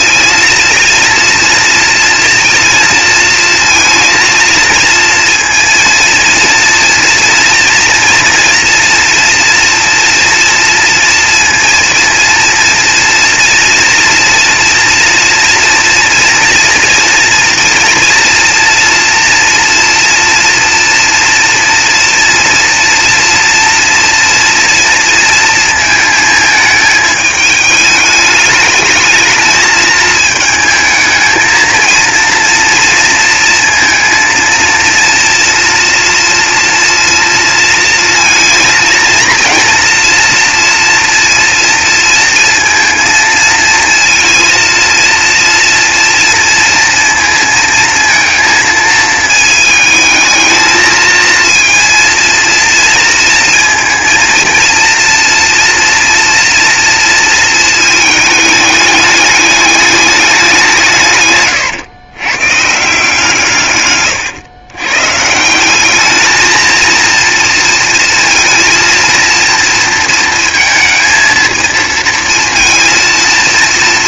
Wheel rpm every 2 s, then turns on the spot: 230, 230, 230, 230, 230, 230, 230, 230, 230, 230, 230, 230, 230, 220, 220, 220, 230, 230, 230, 230, 240, 230, 230, 230, 230, 220, 230, 230, 230, 210, 200, 140, 120, 220, 230, 220, 230.
none